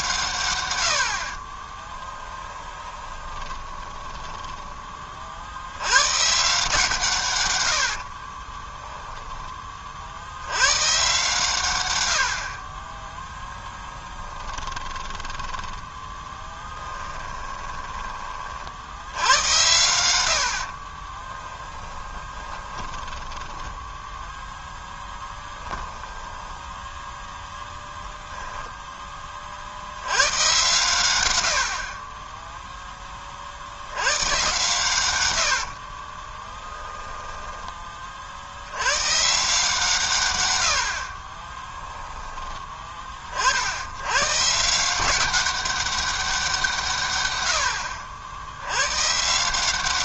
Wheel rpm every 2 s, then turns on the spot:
80, 20, 30, 150, 10, 130, 30, 20, 10, 70, 40, 10, 0, 10, 10, 110, 10, 120, 10, 110, 60, 30, 170, 150, 100.
2-4 8-10 14-18 20-24 36-38